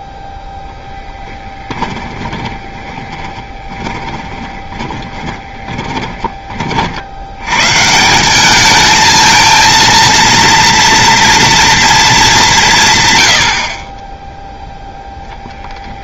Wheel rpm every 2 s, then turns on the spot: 0, 20, 20, 30, 210, 230, 180, 0.
2-6